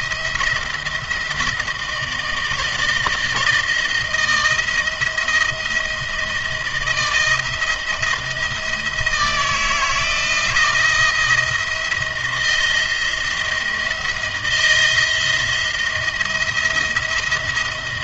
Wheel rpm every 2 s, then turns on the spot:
170, 160, 170, 170, 160, 160, 160, 160, 170.
none